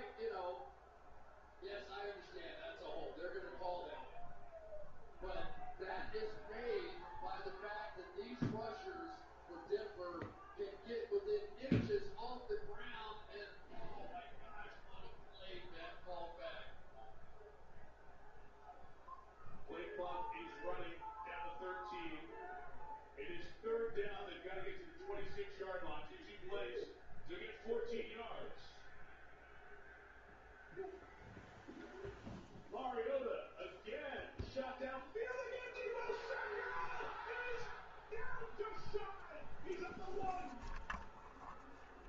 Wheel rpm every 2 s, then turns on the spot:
0, 0, 0, 0, 0, 0, 0, 0, 0, 0, 0, 0, 0, 0, 0, 0, 0, 0, 0, 0, 0.
none